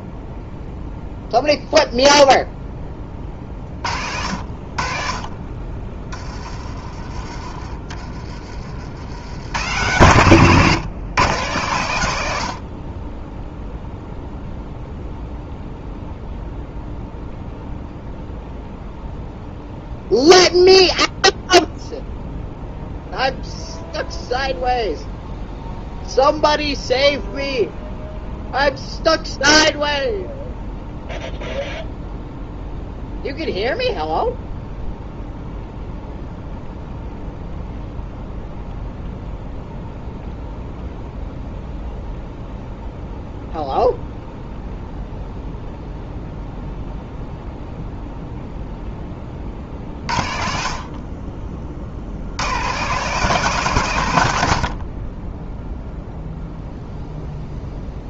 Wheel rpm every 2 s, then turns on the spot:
0, 10, 60, 30, 50, 130, 60, 0, 0, 0, 0, 0, 0, 0, 0, 0, 0, 0, 0, 0, 0, 0, 0, 0, 0, 50, 110, 80, 0.
none